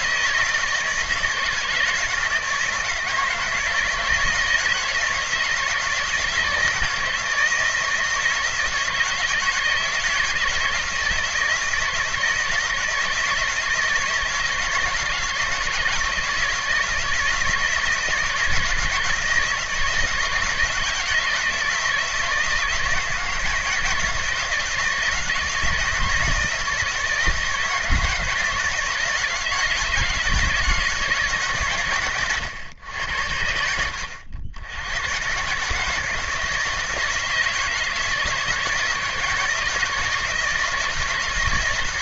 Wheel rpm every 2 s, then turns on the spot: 160, 160, 160, 160, 160, 160, 160, 160, 160, 160, 160, 160, 170, 160, 160, 160, 110, 80, 160, 160, 160.
none